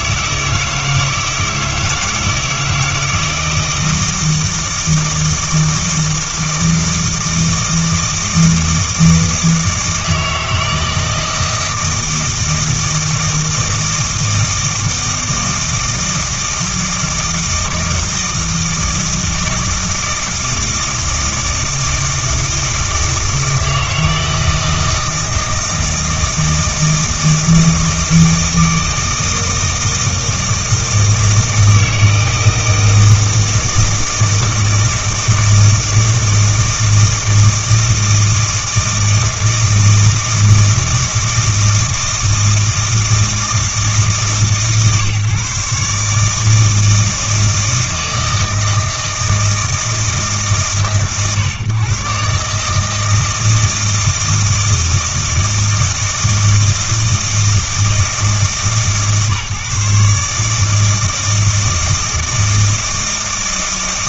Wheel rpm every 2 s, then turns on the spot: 160, 160, 160, 160, 160, 160, 160, 160, 160, 160, 160, 160, 160, 160, 160, 160, 160, 160, 160, 160, 160, 160, 150, 160, 160, 130, 140, 160, 160, 160, 150, 160.
none